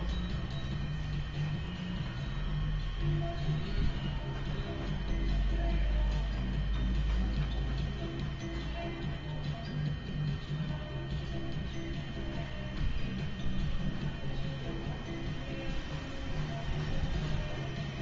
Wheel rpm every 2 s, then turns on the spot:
0, 0, 0, 0, 0, 0, 0, 0, 0.
none